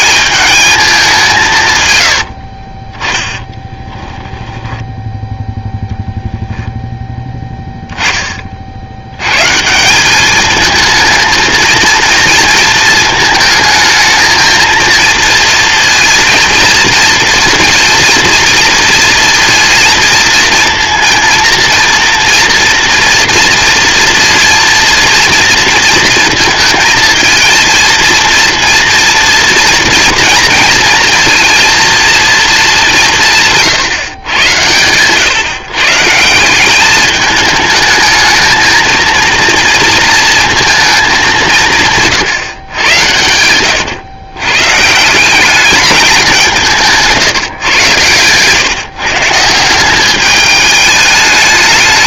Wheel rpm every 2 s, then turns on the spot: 210, 50, 10, 0, 40, 220, 230, 220, 230, 230, 230, 230, 230, 220, 230, 230, 220, 110, 180, 220, 220, 130, 130, 190, 120, 210.
2-6